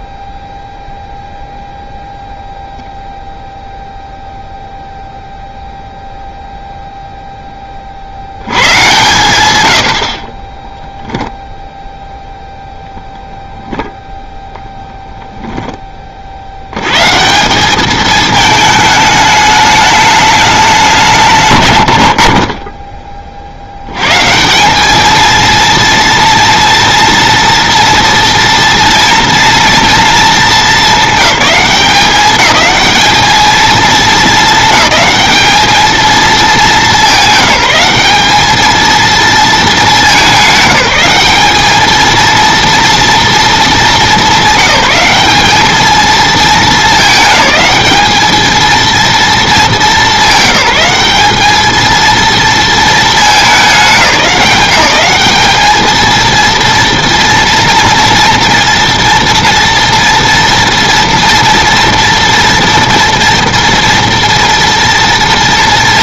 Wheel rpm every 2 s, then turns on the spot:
0, 0, 0, 0, 110, 0, 10, 0, 120, 210, 170, 20, 210, 230, 230, 200, 220, 220, 210, 220, 200, 230, 200, 220, 230, 190, 220, 200, 230, 230, 230, 230, 230.
none